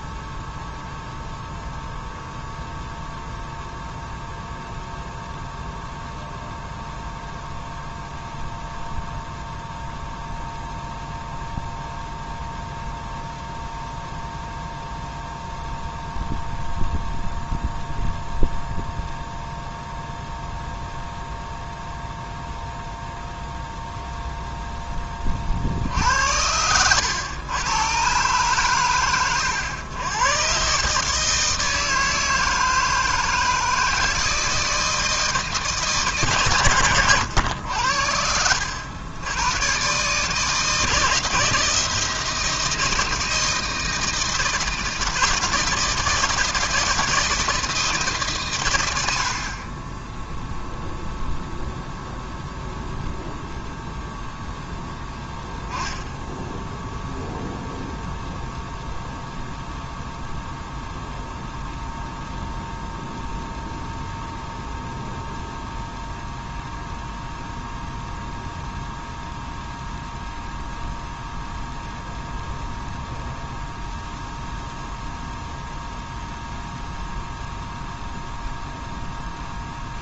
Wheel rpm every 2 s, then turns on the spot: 0, 0, 0, 0, 0, 0, 0, 0, 0, 0, 0, 0, 20, 100, 110, 150, 160, 160, 110, 90, 160, 160, 160, 160, 100, 0, 0, 0, 0, 0, 0, 0, 0, 0, 0, 0, 0, 0, 0, 0.
none